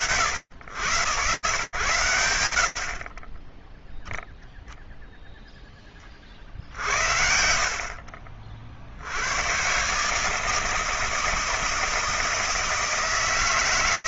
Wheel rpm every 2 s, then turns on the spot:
110, 70, 0, 50, 70, 160, 160.
none